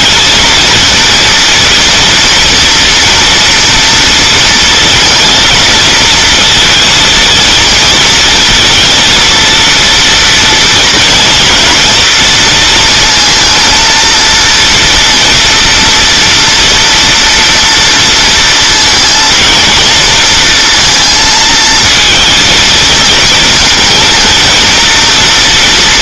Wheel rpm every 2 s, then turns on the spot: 220, 230, 230, 230, 220, 230, 230, 230, 230, 220, 230, 230, 240.
none